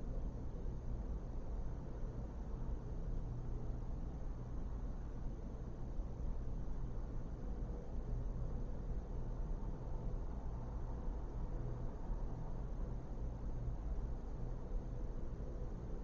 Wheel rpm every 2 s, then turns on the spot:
0, 0, 0, 0, 0, 0, 0, 0.
none